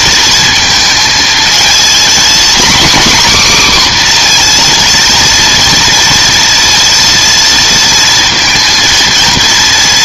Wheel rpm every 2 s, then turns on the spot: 230, 260, 240, 230, 230.
none